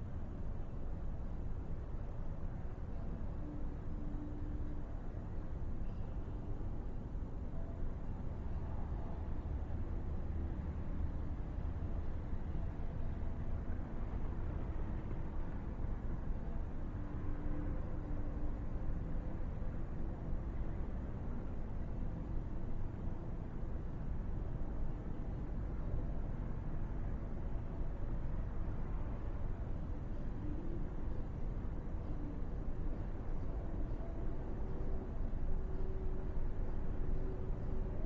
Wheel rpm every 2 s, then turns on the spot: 0, 0, 0, 0, 0, 0, 0, 0, 0, 0, 0, 0, 0, 0, 0, 0, 0, 0, 0.
none